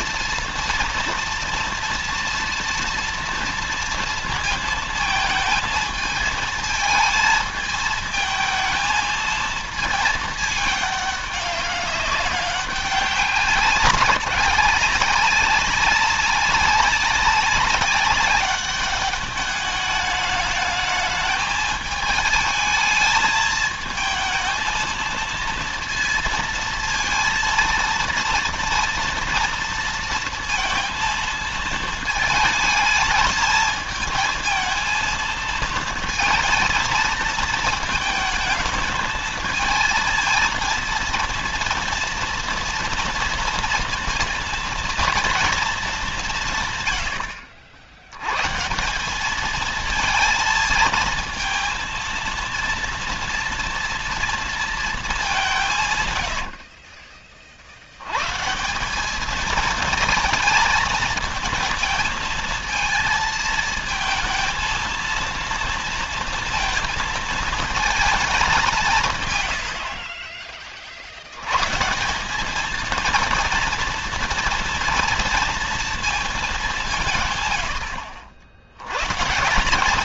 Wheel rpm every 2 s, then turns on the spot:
240, 230, 220, 220, 220, 210, 190, 190, 190, 200, 220, 220, 220, 230, 240, 230, 220, 220, 220, 220, 230, 230, 230, 120, 170, 230, 230, 220, 60, 180, 220, 230, 230, 230, 160, 50, 220, 230, 170, 110.
56-58